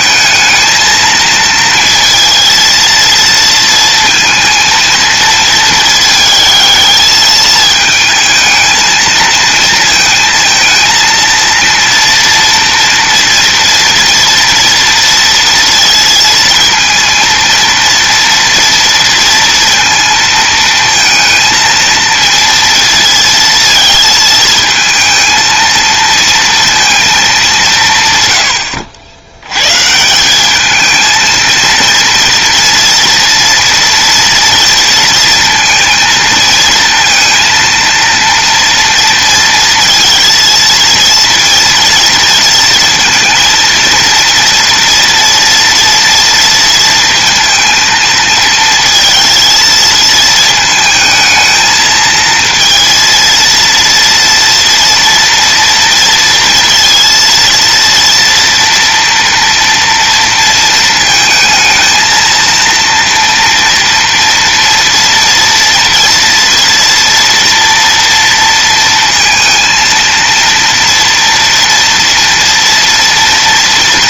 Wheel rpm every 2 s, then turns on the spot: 220, 230, 230, 220, 220, 220, 230, 230, 230, 230, 230, 230, 230, 230, 70, 220, 240, 230, 230, 230, 230, 230, 230, 230, 230, 220, 230, 230, 230, 230, 230, 230, 230, 230, 230, 230, 230.
none